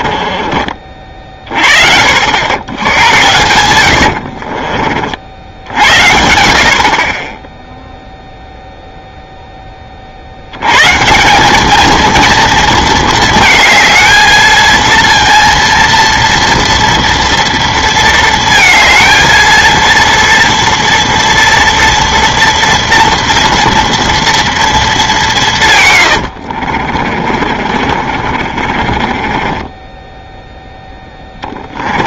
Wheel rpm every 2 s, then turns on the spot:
30, 100, 40, 50, 0, 110, 230, 220, 230, 230, 230, 230, 220, 50, 40, 10.
4-6 26-30